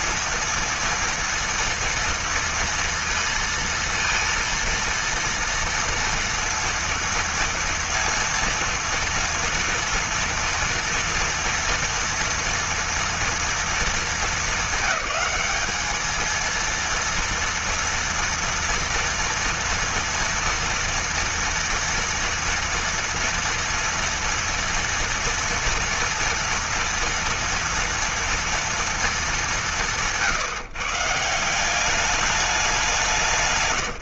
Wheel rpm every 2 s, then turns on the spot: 230, 230, 230, 230, 230, 230, 230, 220, 230, 230, 230, 240, 230, 230, 230, 150, 190.
none